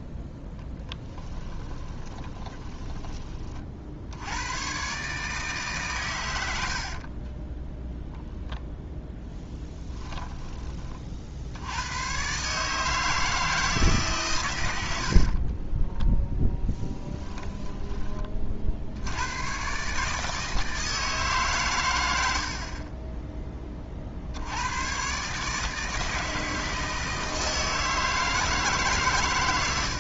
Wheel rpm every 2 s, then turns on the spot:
10, 10, 120, 70, 0, 20, 150, 100, 10, 60, 160, 40, 100, 160, 150.
2-4 6-8 16-18